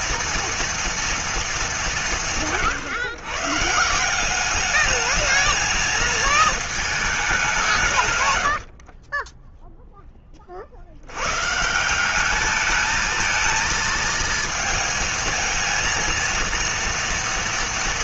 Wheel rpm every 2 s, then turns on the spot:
230, 140, 190, 220, 120, 40, 210, 230, 230.
none